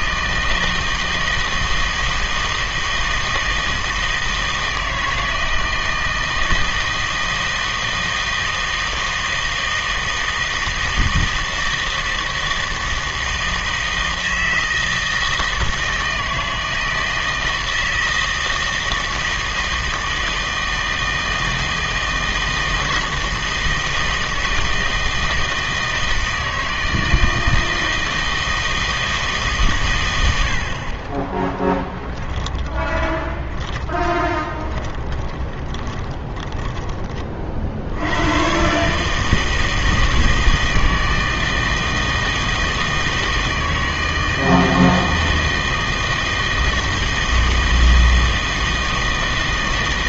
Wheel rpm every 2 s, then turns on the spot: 160, 160, 160, 160, 160, 160, 160, 160, 160, 160, 160, 160, 160, 160, 160, 60, 20, 20, 10, 120, 160, 160, 160, 160, 160.
32-36